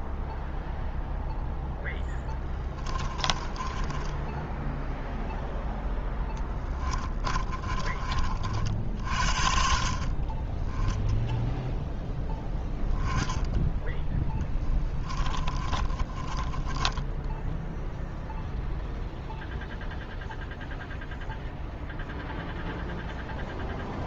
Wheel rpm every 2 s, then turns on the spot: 0, 20, 10, 20, 50, 10, 0, 10, 20, 0, 0, 0.
2-8 14-18